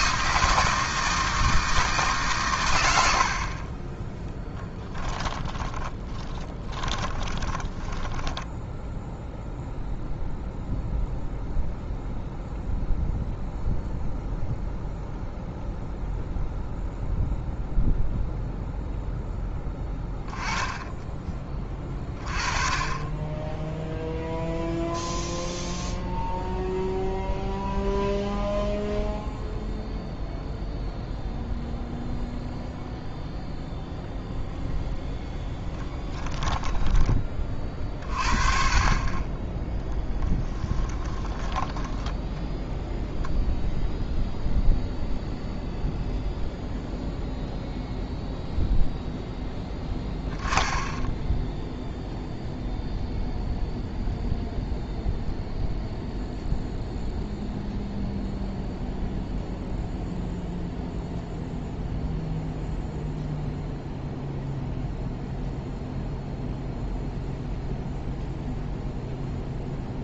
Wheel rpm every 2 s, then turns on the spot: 160, 100, 10, 20, 10, 0, 0, 0, 0, 0, 10, 20, 0, 0, 0, 0, 0, 0, 10, 30, 10, 0, 0, 0, 0, 10, 0, 0, 0, 0, 0, 0, 0, 0, 0.
4-10 36-38 40-42